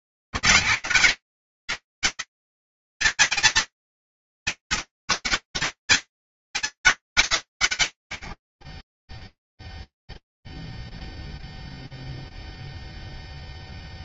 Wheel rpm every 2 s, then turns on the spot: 100, 220, 170, 200, 10, 0, 0.
none